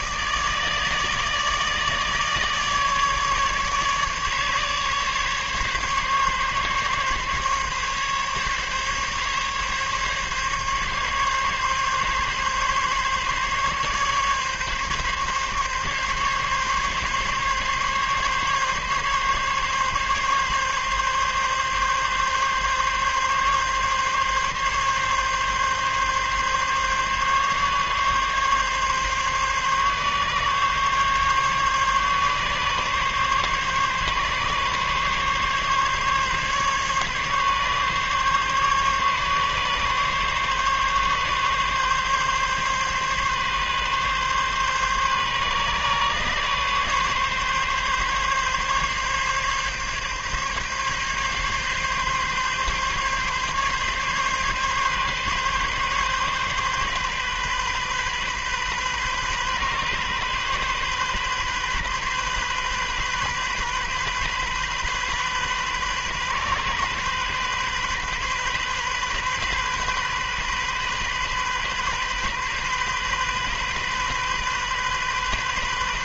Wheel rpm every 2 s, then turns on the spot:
160, 150, 140, 140, 140, 140, 140, 140, 140, 140, 140, 140, 140, 140, 140, 140, 140, 140, 140, 140, 140, 140, 140, 140, 140, 140, 140, 140, 130, 130, 130, 130, 130, 130, 130, 130, 130, 130.
none